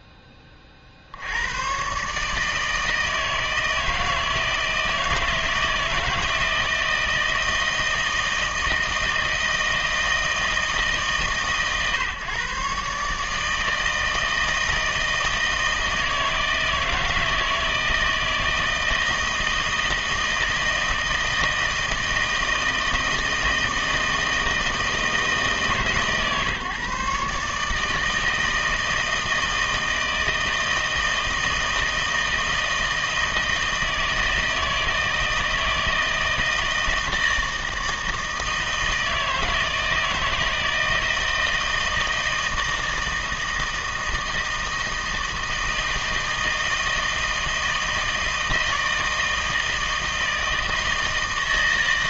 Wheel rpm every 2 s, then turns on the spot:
20, 160, 160, 160, 160, 160, 140, 160, 160, 160, 160, 160, 160, 140, 160, 160, 160, 160, 160, 160, 160, 160, 160, 160, 160, 160.
none